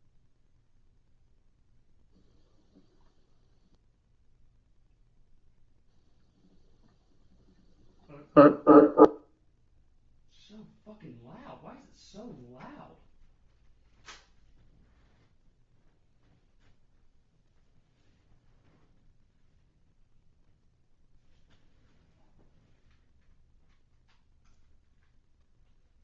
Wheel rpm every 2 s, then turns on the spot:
0, 0, 0, 0, 0, 0, 0, 0, 0, 0, 0, 0, 0.
none